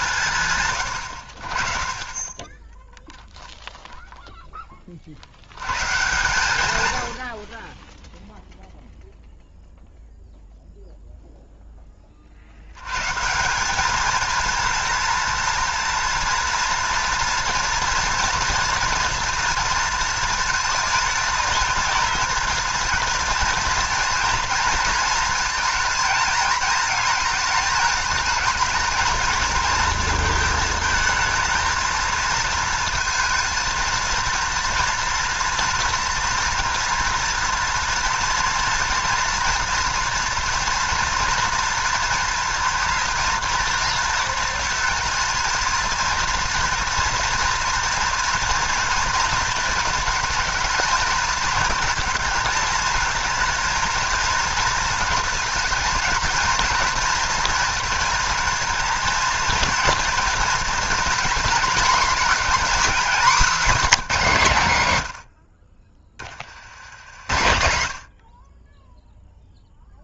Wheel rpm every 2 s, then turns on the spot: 120, 10, 10, 120, 0, 0, 90, 220, 230, 240, 230, 230, 230, 220, 220, 220, 220, 230, 230, 240, 230, 230, 230, 230, 230, 220, 220, 220, 220, 230, 230, 230, 150, 80, 20.
none